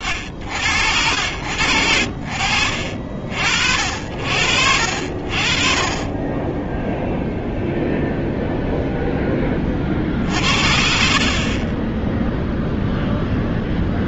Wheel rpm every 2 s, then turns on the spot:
50, 70, 10, 0, 50, 0, 20.
none